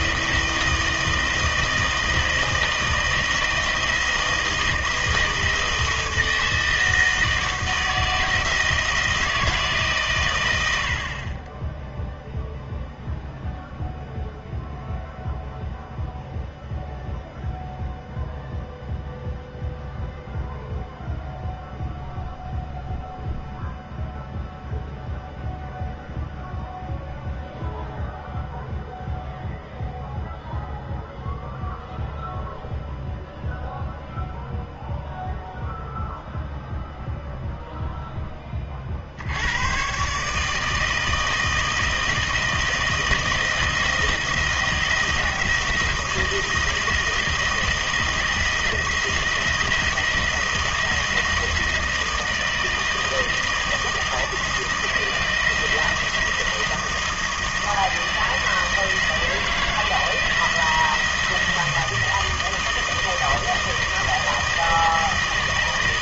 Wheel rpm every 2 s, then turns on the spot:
160, 160, 160, 160, 160, 70, 0, 0, 0, 0, 0, 0, 0, 0, 0, 0, 0, 0, 0, 40, 160, 160, 170, 160, 160, 160, 160, 160, 160, 160, 170, 160, 160.
none